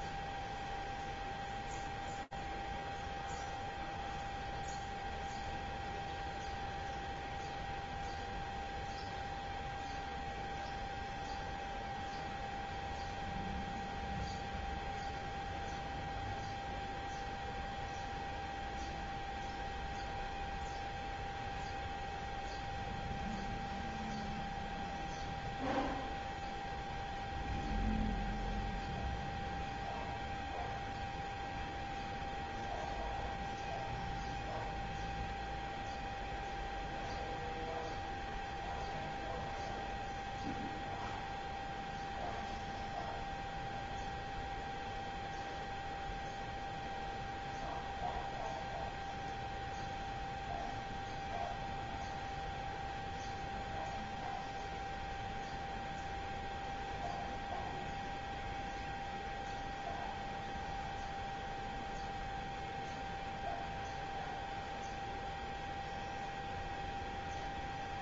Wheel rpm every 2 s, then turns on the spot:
0, 0, 0, 0, 0, 0, 0, 0, 0, 0, 0, 0, 0, 0, 0, 0, 0, 0, 0, 0, 0, 0, 0, 0, 0, 0, 0, 0, 0, 0, 0, 0, 0, 0.
none